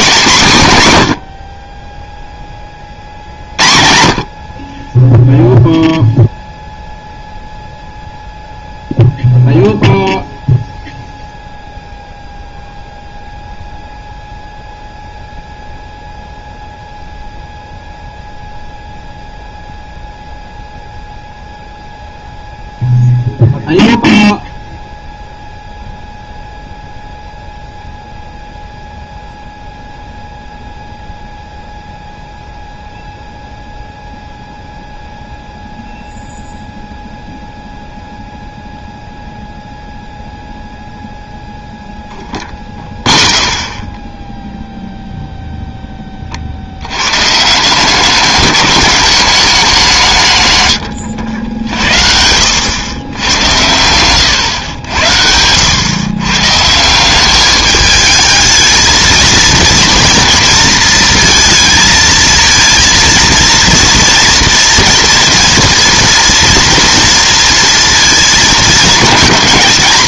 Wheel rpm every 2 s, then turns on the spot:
180, 20, 40, 0, 0, 0, 0, 0, 0, 0, 0, 0, 0, 0, 0, 0, 0, 0, 0, 0, 0, 0, 0, 60, 200, 130, 90, 110, 140, 220, 230, 230, 230, 240, 220.
none